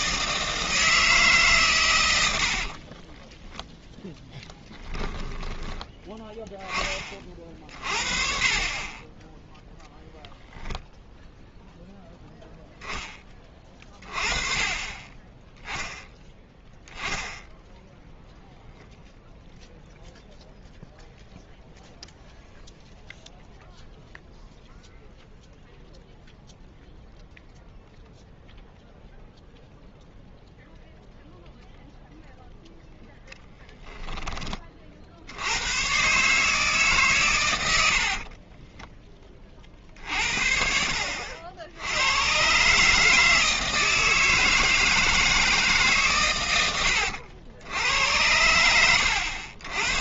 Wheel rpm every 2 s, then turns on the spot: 160, 50, 10, 10, 30, 0, 0, 30, 0, 0, 0, 0, 0, 0, 0, 0, 0, 30, 150, 20, 60, 140, 160, 100, 90.
2-6 38-40